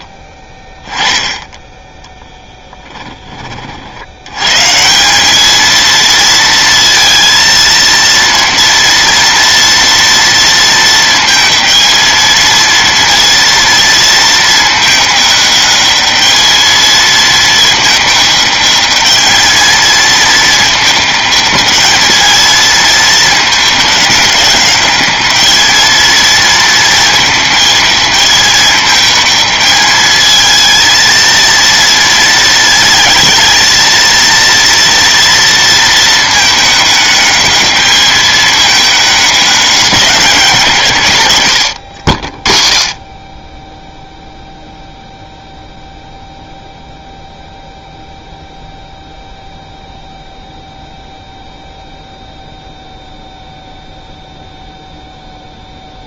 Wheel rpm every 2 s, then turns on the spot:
10, 10, 170, 230, 230, 230, 230, 210, 220, 210, 220, 220, 210, 230, 220, 230, 220, 230, 210, 210, 140, 20, 0, 0, 0, 0, 0, 0.
2-4